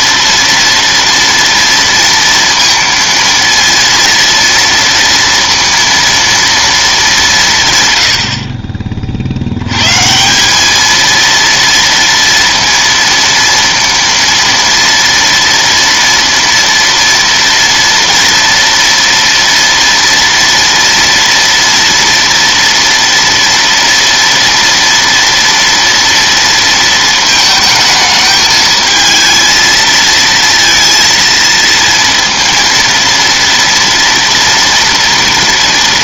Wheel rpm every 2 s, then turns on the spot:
230, 230, 230, 210, 30, 210, 230, 230, 230, 230, 230, 230, 230, 230, 220, 230, 230, 230.
none